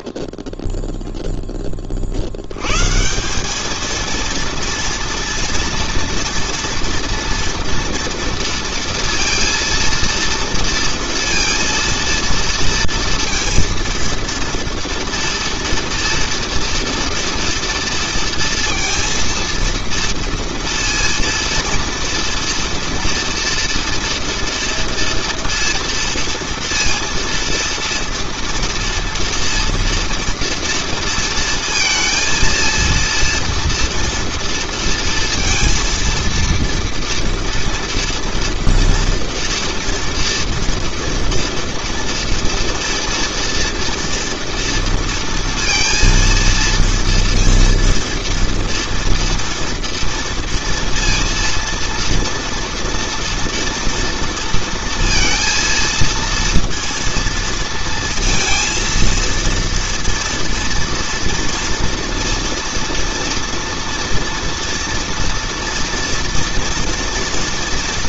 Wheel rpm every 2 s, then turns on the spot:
0, 170, 230, 230, 230, 230, 230, 230, 230, 230, 230, 230, 230, 230, 240, 230, 230, 230, 230, 230, 230, 230, 230, 230, 240, 230, 240, 230, 230, 230, 230, 230, 230, 230.
none